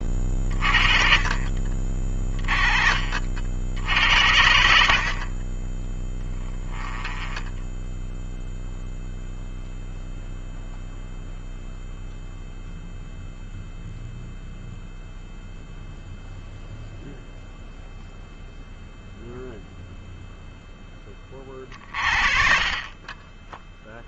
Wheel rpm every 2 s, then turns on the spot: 30, 40, 70, 10, 0, 0, 0, 0, 0, 0, 0, 40.
6-8